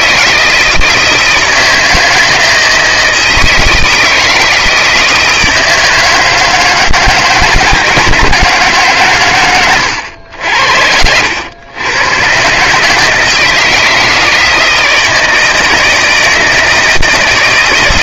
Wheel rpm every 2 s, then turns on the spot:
160, 160, 160, 160, 120, 100, 160, 160, 140.
none